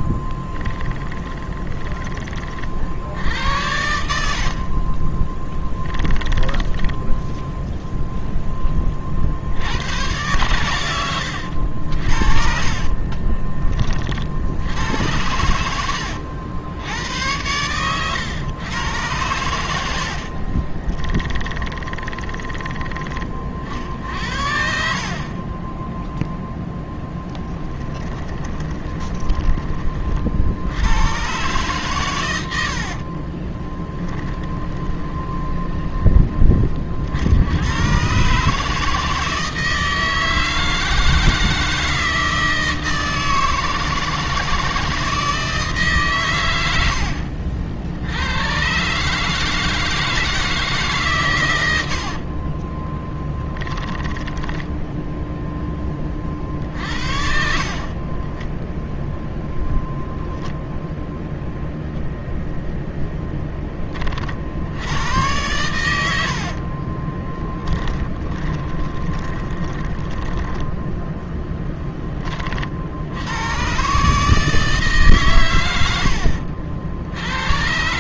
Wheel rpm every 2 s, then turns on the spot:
20, 60, 40, 10, 20, 110, 50, 70, 90, 110, 30, 20, 60, 0, 20, 80, 70, 20, 40, 150, 160, 160, 160, 80, 130, 160, 30, 10, 50, 0, 0, 0, 70, 50, 20, 10, 60, 140, 70.
0-2 4-8 10-14 20-22 28-30 32-36 52-56 66-70